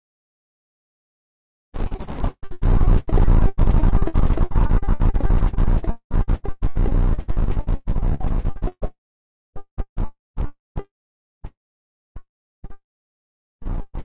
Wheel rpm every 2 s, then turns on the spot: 0, 0, 0, 0, 0, 0, 0.
none